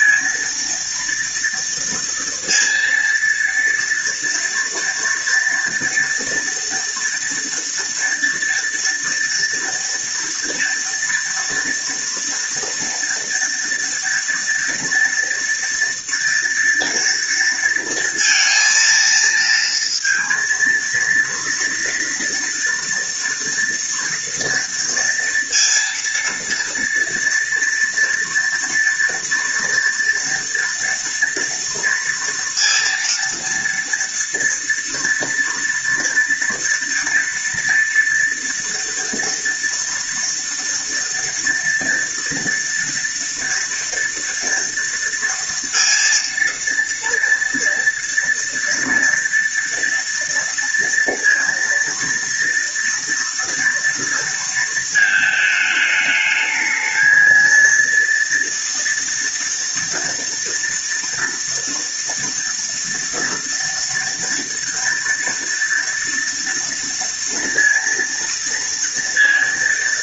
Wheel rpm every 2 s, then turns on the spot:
230, 230, 230, 230, 230, 230, 230, 230, 230, 230, 230, 230, 230, 240, 230, 230, 230, 230, 230, 230, 230, 240, 230, 230, 230, 230, 230, 220, 220, 230, 230, 230, 230, 230, 230.
none